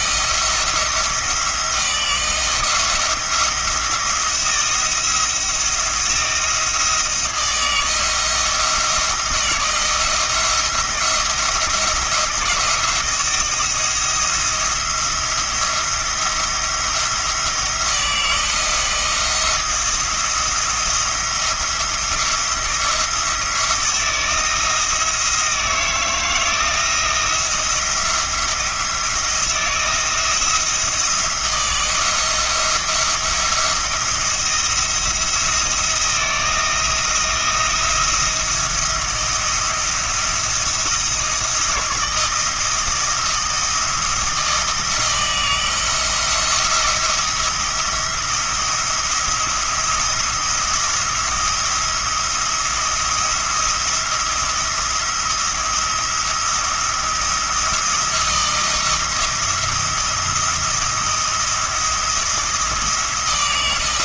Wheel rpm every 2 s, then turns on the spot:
160, 170, 170, 160, 160, 170, 160, 170, 170, 170, 170, 170, 160, 170, 170, 170, 170, 160, 170, 170, 170, 170, 160, 170, 170, 170, 170, 170, 170, 160, 170, 160.
none